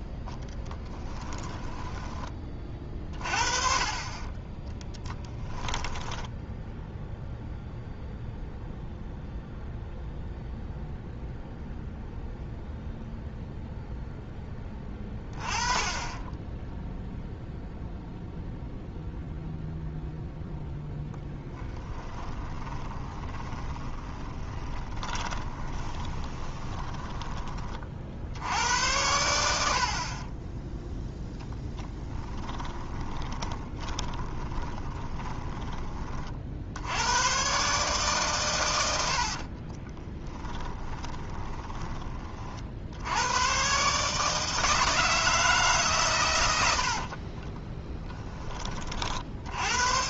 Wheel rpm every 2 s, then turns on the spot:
10, 30, 10, 0, 0, 0, 0, 10, 0, 0, 0, 20, 20, 20, 90, 0, 20, 20, 100, 70, 20, 80, 160, 70, 40.
0-2 4-6 22-26 32-36 38-42 46-48